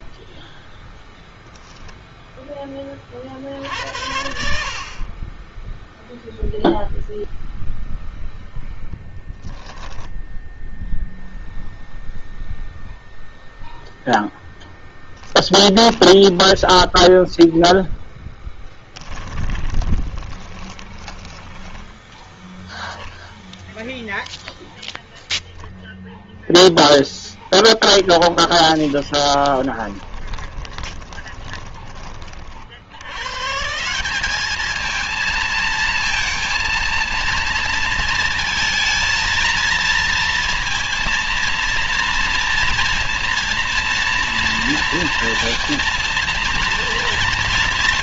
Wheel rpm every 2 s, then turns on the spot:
0, 20, 40, 0, 10, 0, 0, 10, 10, 10, 20, 10, 0, 0, 20, 20, 90, 220, 230, 220, 230, 230, 230, 230.
16-22 28-32